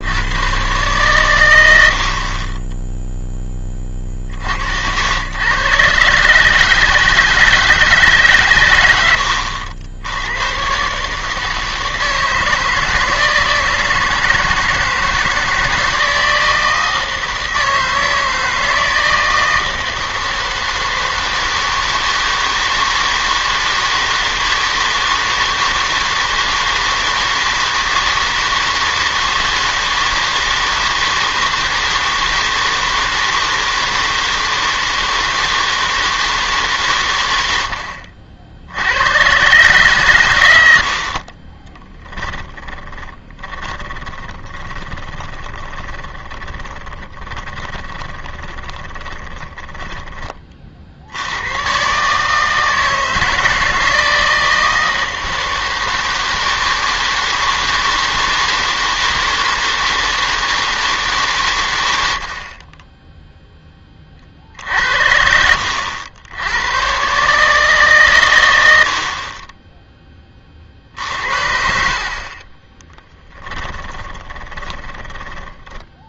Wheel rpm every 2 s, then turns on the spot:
110, 20, 70, 150, 110, 120, 160, 160, 160, 160, 160, 160, 160, 160, 160, 160, 160, 160, 150, 70, 90, 30, 10, 20, 20, 40, 160, 160, 160, 160, 160, 30, 50, 100, 90, 50, 20, 20.
42-50 72-76